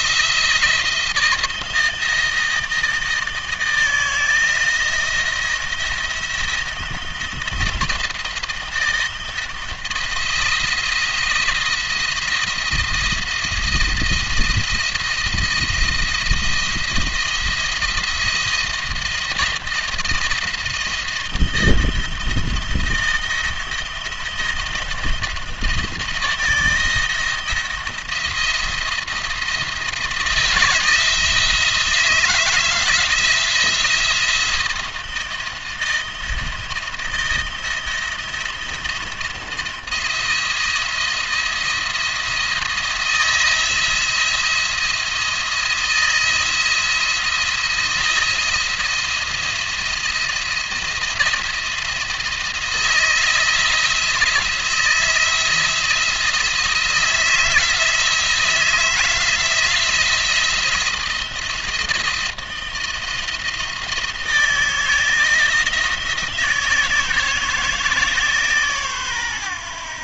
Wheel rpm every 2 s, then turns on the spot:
170, 160, 160, 170, 160, 170, 170, 170, 170, 170, 170, 170, 160, 170, 170, 160, 170, 170, 170, 170, 170, 160, 170, 160, 170, 170, 170, 170, 170, 160, 170, 170, 160, 160, 150.
none